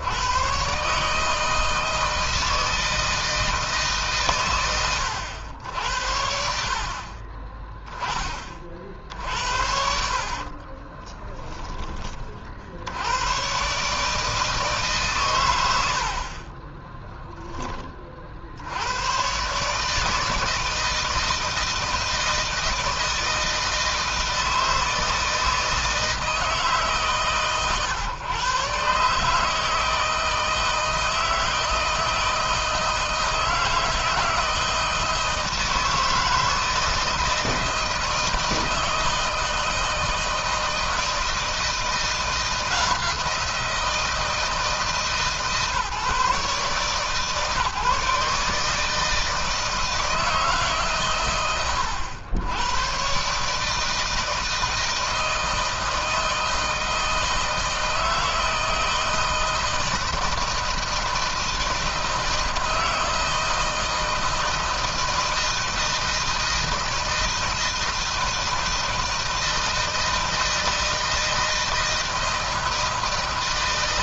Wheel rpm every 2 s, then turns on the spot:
130, 160, 110, 50, 50, 20, 80, 140, 20, 90, 160, 160, 160, 150, 140, 160, 160, 160, 160, 160, 160, 170, 150, 140, 150, 140, 120, 160, 160, 160, 160, 160, 160, 160, 160, 160, 160.
10-12 16-18